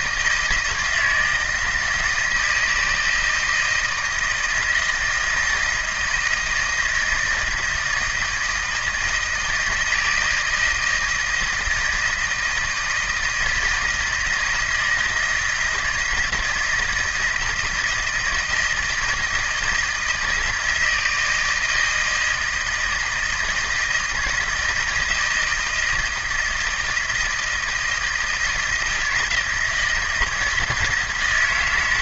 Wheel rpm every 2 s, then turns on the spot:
160, 160, 160, 160, 160, 160, 160, 160, 160, 160, 160, 160, 160, 160, 170, 160.
none